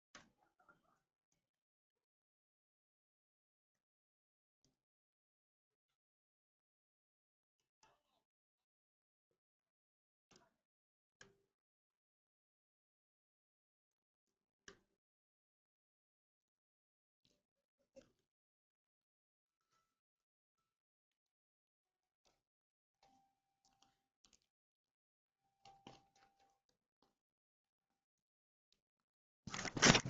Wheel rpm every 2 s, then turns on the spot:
0, 0, 0, 0, 0, 0, 0, 0, 0, 0, 0, 0, 0, 0, 0.
none